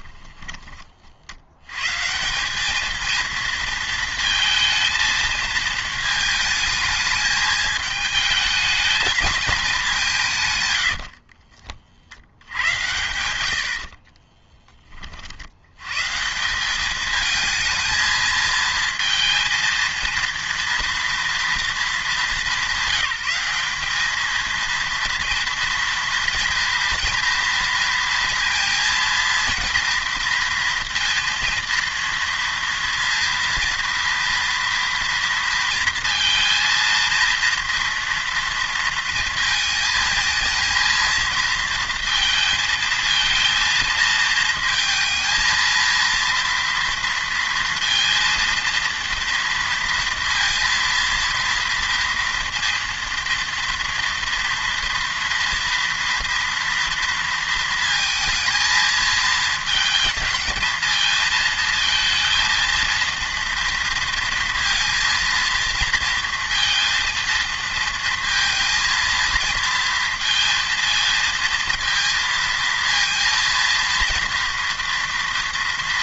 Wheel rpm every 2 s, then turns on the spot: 20, 200, 220, 220, 210, 110, 90, 20, 190, 220, 230, 190, 230, 230, 230, 230, 230, 230, 230, 230, 220, 230, 230, 230, 230, 230, 230, 230, 230, 220, 230, 230, 230, 230, 230, 230, 230, 230.
10-12